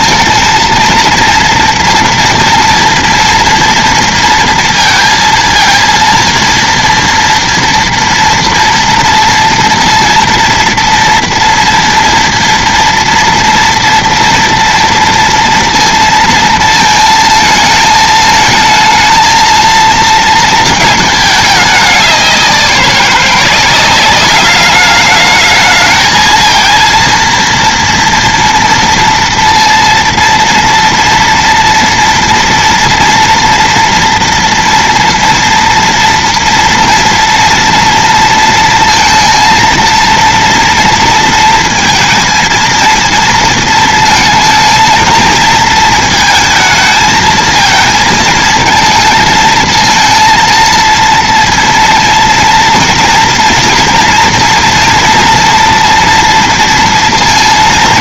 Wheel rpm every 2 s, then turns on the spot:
230, 230, 230, 230, 230, 230, 230, 230, 230, 220, 220, 180, 200, 230, 230, 230, 240, 230, 230, 230, 230, 230, 220, 220, 230, 230, 230, 230, 230.
none